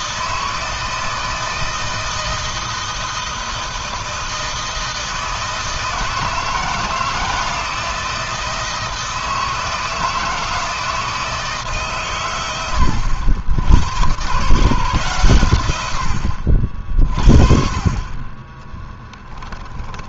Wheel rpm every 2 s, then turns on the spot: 160, 160, 160, 160, 160, 160, 100, 130, 50, 20.
18-20